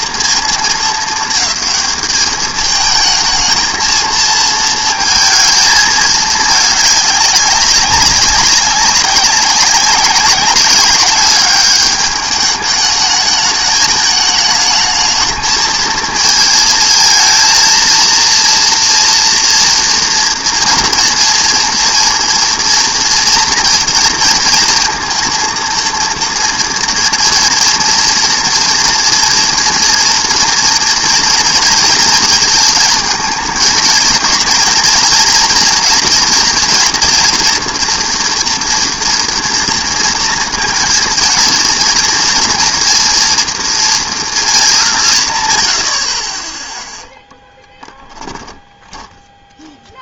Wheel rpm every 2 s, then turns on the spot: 220, 220, 220, 210, 190, 190, 210, 210, 230, 230, 230, 230, 230, 230, 230, 230, 220, 230, 230, 230, 230, 230, 200, 10, 20.
48-50